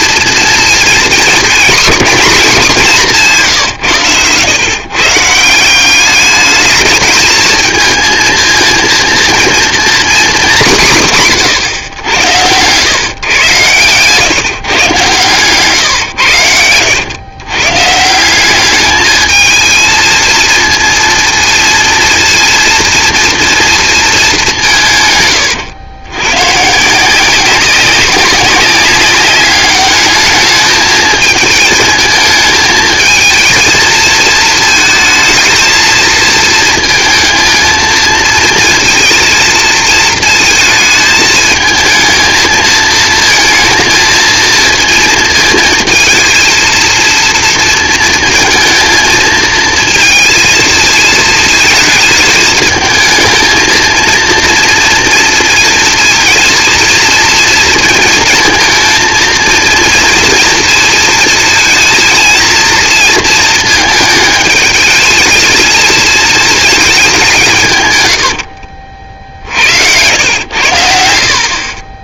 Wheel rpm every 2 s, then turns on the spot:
230, 190, 140, 220, 230, 180, 120, 130, 110, 210, 230, 230, 150, 160, 200, 220, 220, 220, 230, 230, 220, 230, 230, 230, 230, 230, 220, 230, 230, 230, 230, 230, 220, 210, 60, 80.
68-70